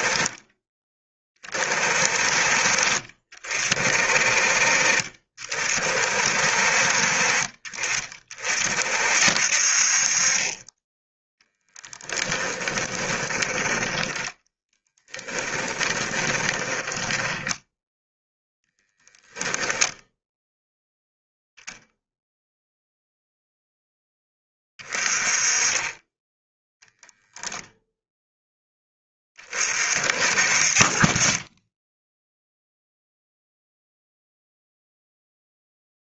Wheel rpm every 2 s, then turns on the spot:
20, 40, 40, 40, 50, 20, 30, 20, 20, 10, 0, 0, 20, 0, 10, 40, 0, 0.
12-18